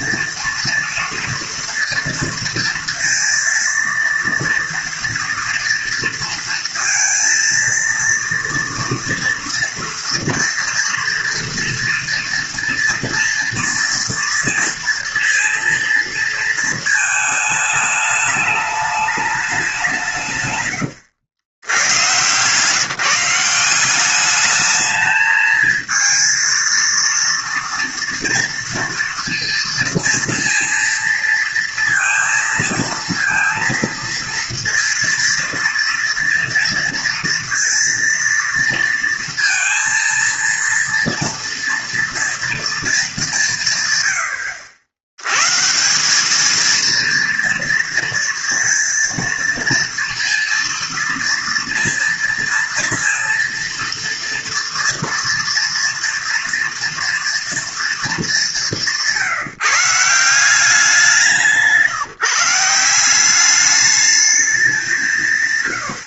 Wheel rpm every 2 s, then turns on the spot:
230, 230, 230, 230, 230, 230, 230, 230, 230, 210, 130, 140, 210, 230, 230, 230, 230, 230, 230, 230, 230, 230, 80, 220, 230, 230, 230, 230, 230, 200, 180, 160, 200.
none